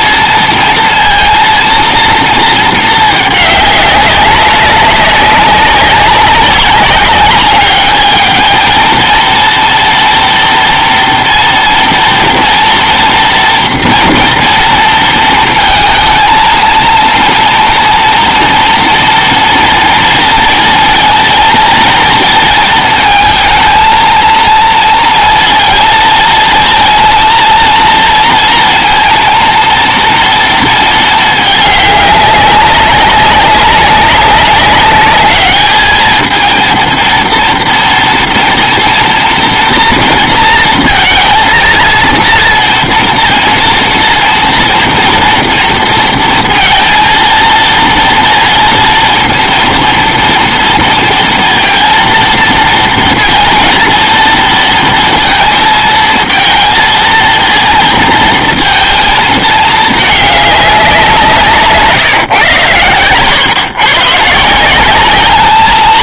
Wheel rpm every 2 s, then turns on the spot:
230, 220, 200, 190, 220, 230, 230, 230, 230, 230, 230, 220, 230, 220, 230, 230, 200, 200, 220, 240, 230, 230, 230, 230, 230, 230, 230, 230, 220, 220, 200, 130, 150.
none